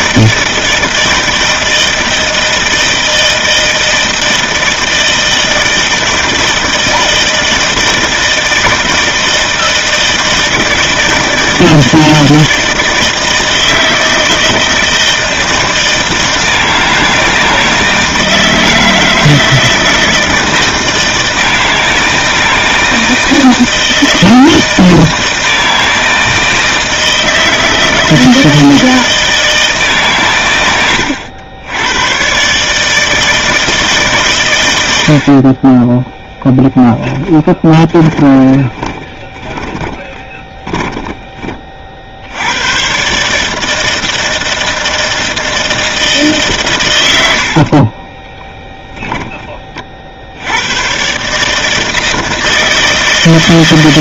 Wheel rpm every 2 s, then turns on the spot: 160, 160, 160, 160, 160, 160, 160, 160, 160, 160, 160, 160, 160, 160, 160, 100, 150, 90, 10, 20, 10, 120, 160, 130, 10, 100, 160.
36-42